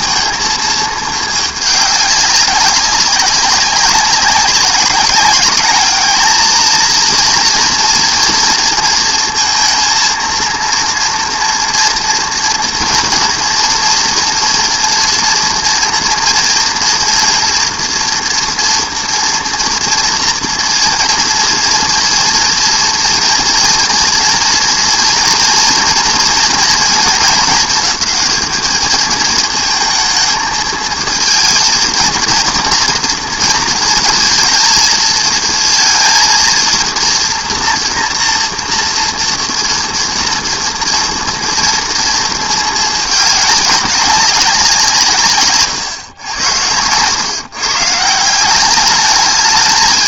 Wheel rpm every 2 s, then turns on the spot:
220, 190, 200, 220, 240, 230, 230, 240, 230, 240, 230, 230, 230, 230, 210, 220, 230, 220, 230, 230, 230, 220, 190, 100, 190.
none